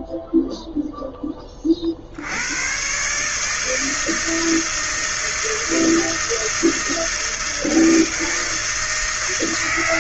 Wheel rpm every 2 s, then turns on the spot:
0, 100, 160, 160, 160.
none